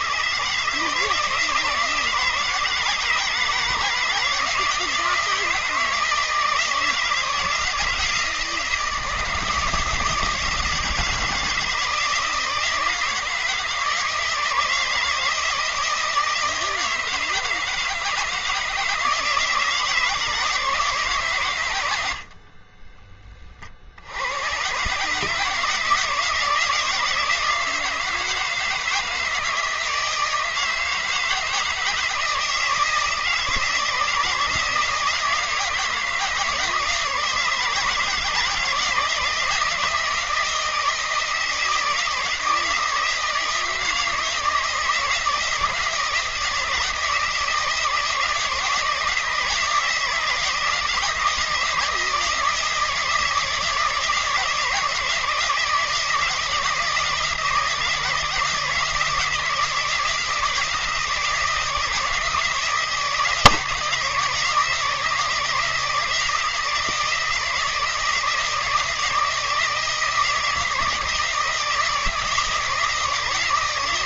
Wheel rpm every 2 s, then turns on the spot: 150, 160, 160, 160, 160, 160, 160, 160, 160, 160, 150, 30, 130, 160, 160, 160, 160, 160, 160, 160, 170, 160, 160, 160, 160, 160, 160, 160, 160, 160, 160, 160, 160, 160, 160, 160, 160.
22-24